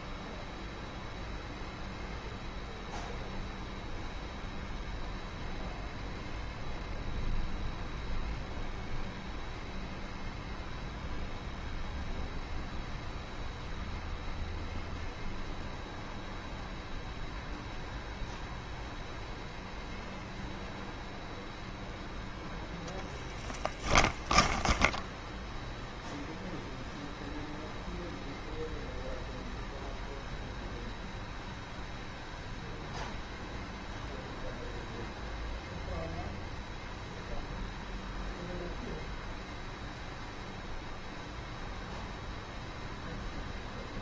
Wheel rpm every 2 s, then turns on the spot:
0, 0, 0, 0, 0, 0, 0, 0, 0, 0, 0, 0, 10, 0, 0, 0, 0, 0, 0, 0, 0, 0.
24-26